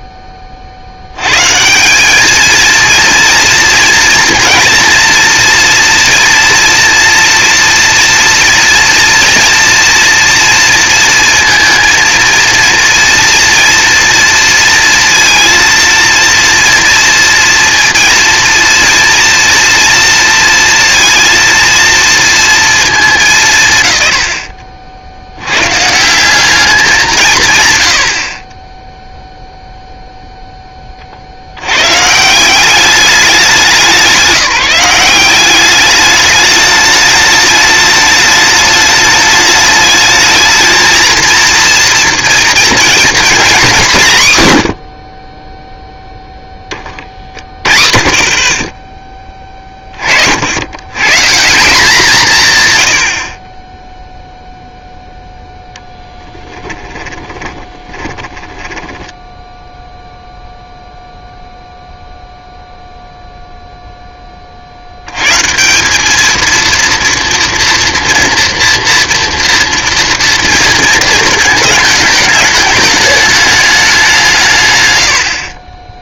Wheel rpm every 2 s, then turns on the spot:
70, 230, 230, 230, 230, 230, 230, 230, 230, 230, 230, 200, 60, 200, 10, 20, 190, 180, 210, 210, 230, 230, 110, 30, 20, 90, 140, 0, 10, 10, 0, 0, 70, 230, 230, 230, 210, 120.
56-60